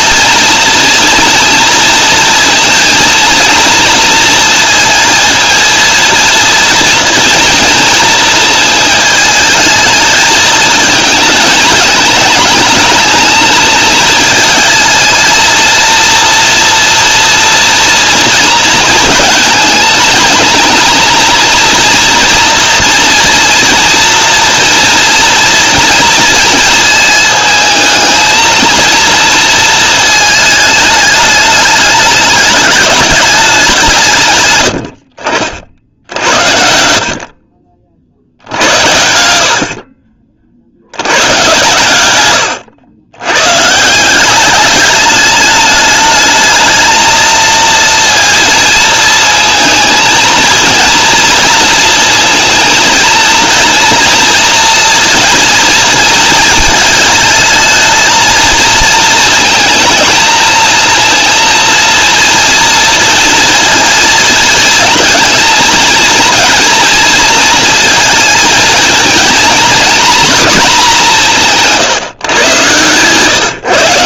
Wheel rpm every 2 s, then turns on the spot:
230, 230, 230, 230, 220, 220, 220, 220, 230, 230, 220, 240, 230, 220, 230, 210, 210, 100, 70, 80, 80, 100, 200, 220, 230, 230, 230, 230, 220, 230, 230, 230, 230, 220, 220, 230, 120.
none